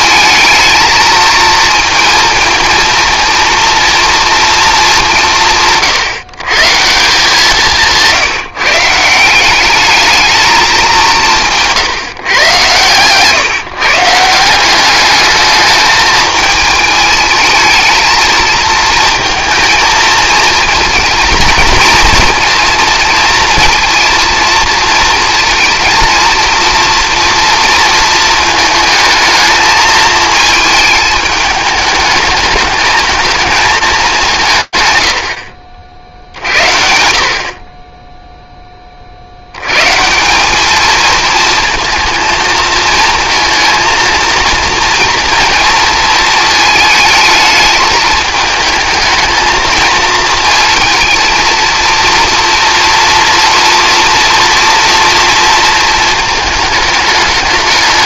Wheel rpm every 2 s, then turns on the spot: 230, 230, 220, 160, 160, 200, 130, 190, 220, 230, 220, 230, 230, 230, 220, 220, 210, 140, 70, 20, 210, 220, 230, 220, 220, 230, 230, 230, 220.
none